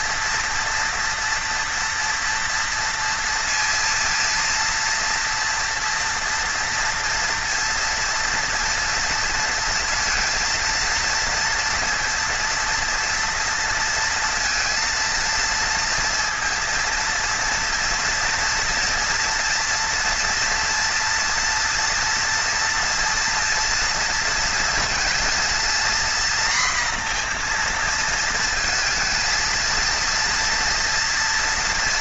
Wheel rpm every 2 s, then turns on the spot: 230, 230, 230, 230, 230, 230, 230, 230, 230, 230, 230, 230, 230, 240, 230, 230.
none